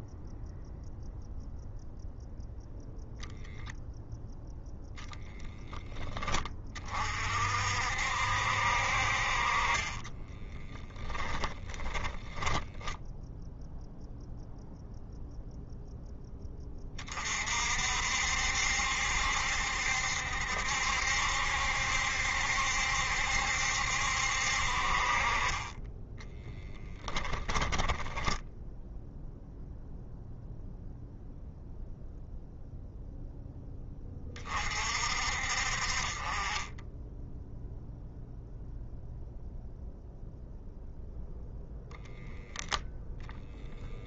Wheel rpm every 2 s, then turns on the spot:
0, 0, 0, 40, 60, 30, 10, 0, 30, 70, 70, 70, 50, 20, 10, 0, 0, 40, 10, 0, 0, 0.
10-14 26-28